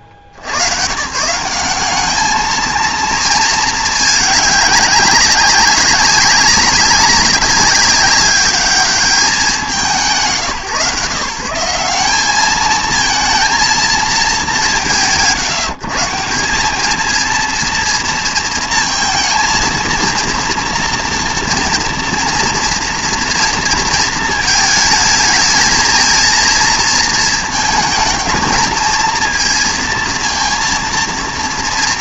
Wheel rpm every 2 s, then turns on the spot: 100, 220, 200, 200, 200, 130, 200, 200, 190, 230, 230, 230, 220, 230, 220, 230.
none